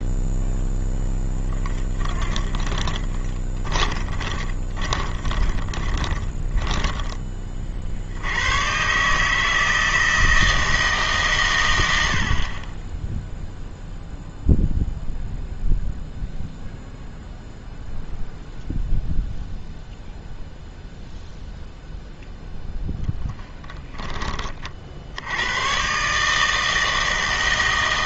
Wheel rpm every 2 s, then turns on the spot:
0, 30, 30, 10, 110, 160, 30, 0, 0, 0, 0, 0, 40, 160.
2-8